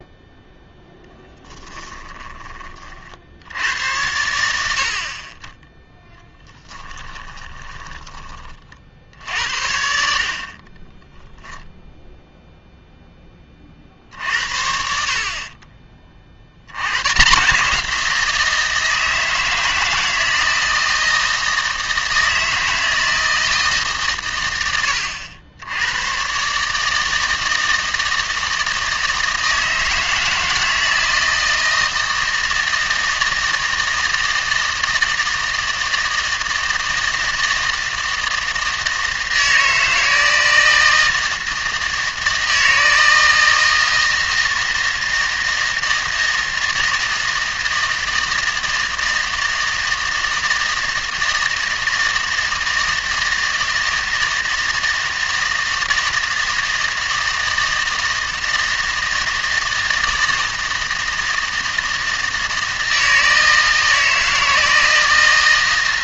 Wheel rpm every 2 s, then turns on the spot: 0, 40, 70, 10, 40, 20, 0, 60, 90, 160, 160, 160, 100, 150, 160, 160, 160, 160, 160, 160, 160, 160, 160, 160, 160, 160, 160, 160, 160, 160, 160, 160, 160.
6-8